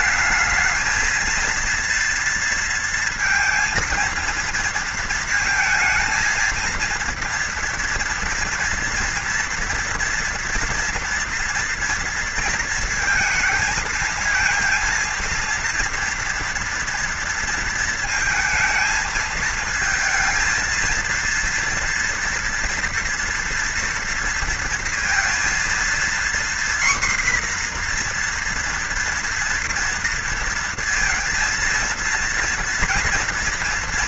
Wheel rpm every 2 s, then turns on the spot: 220, 230, 230, 230, 230, 240, 230, 230, 230, 220, 230, 230, 230, 240, 240, 230, 230.
none